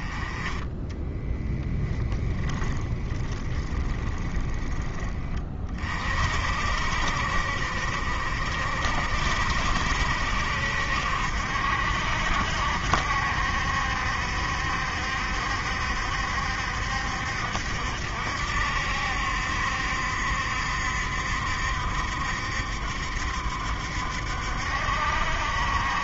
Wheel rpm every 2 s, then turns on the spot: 10, 10, 20, 50, 50, 60, 70, 60, 60, 70, 70, 70, 60.
0-4